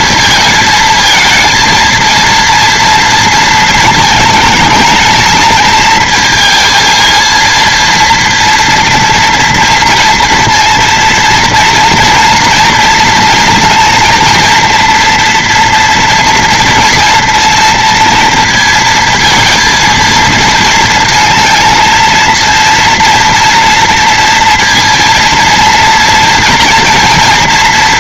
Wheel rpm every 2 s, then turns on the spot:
220, 230, 220, 230, 230, 230, 240, 230, 230, 230, 230, 230, 230, 230.
none